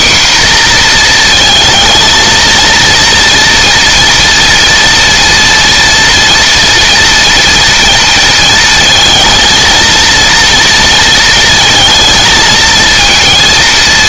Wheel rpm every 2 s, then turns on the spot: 240, 230, 230, 240, 230, 230, 230.
none